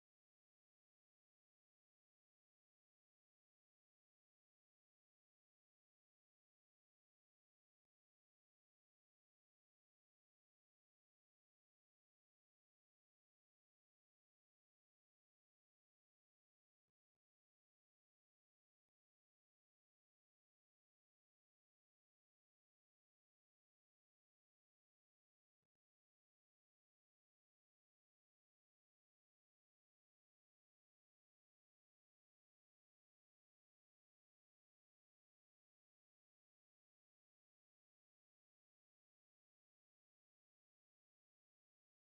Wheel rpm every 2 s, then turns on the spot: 0, 0, 0, 0, 0, 0, 0, 0, 0, 0, 0, 0, 0, 0, 0, 0, 0, 0, 0, 0, 0.
none